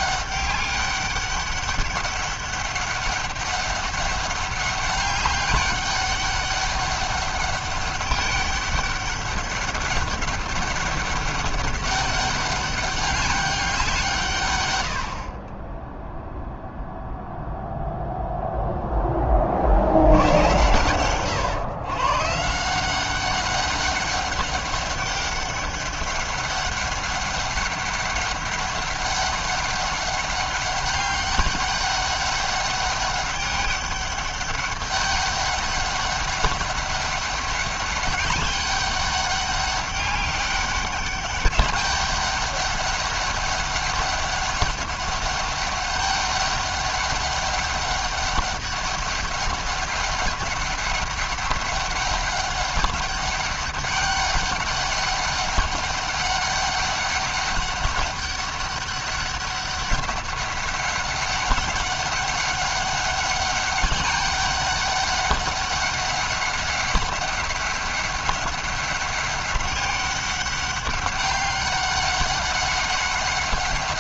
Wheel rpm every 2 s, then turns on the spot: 200, 200, 200, 200, 200, 200, 200, 70, 0, 20, 120, 190, 200, 200, 200, 200, 200, 200, 200, 200, 200, 200, 200, 190, 200, 200, 200, 200, 200, 200, 200, 200, 200, 190, 190, 200, 190.
14-16